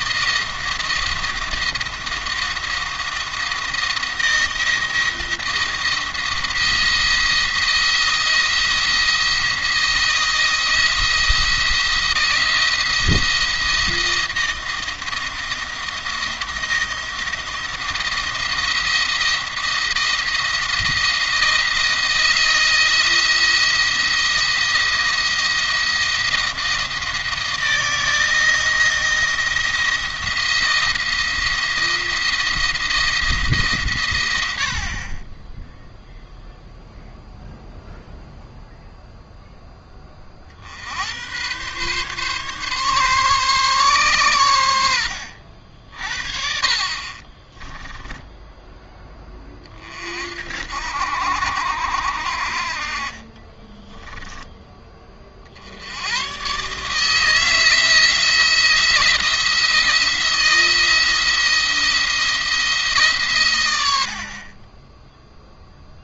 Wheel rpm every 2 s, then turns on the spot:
170, 170, 170, 170, 170, 170, 160, 160, 170, 170, 170, 170, 170, 160, 170, 170, 170, 70, 0, 0, 60, 140, 100, 50, 10, 60, 60, 10, 130, 170, 170, 160, 30.
none